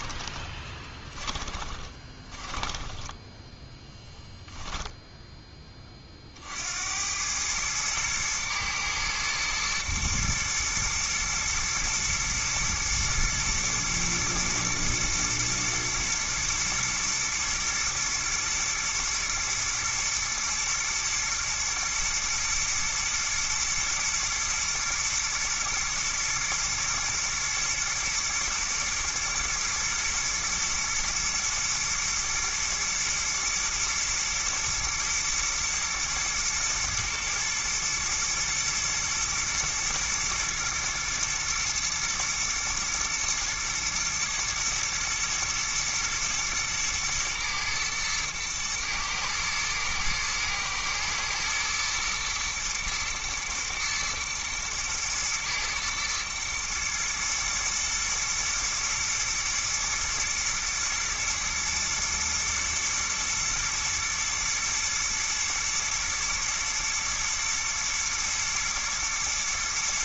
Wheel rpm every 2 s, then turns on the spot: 20, 10, 10, 70, 110, 120, 110, 120, 120, 110, 120, 120, 120, 120, 110, 110, 120, 120, 110, 120, 120, 120, 120, 110, 120, 110, 110, 110, 110, 120, 120, 110, 110, 120, 120.
0-6